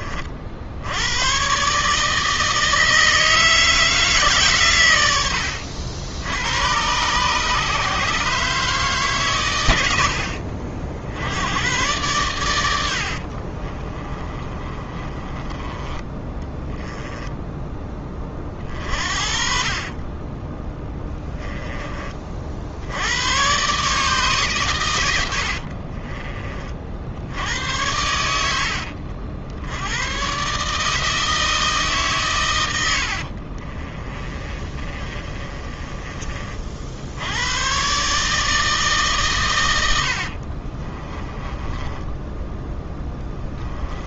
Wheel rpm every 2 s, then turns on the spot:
80, 160, 110, 120, 140, 70, 80, 30, 10, 40, 10, 80, 110, 50, 70, 150, 90, 30, 70, 150, 30, 10.
12-22 32-36 40-44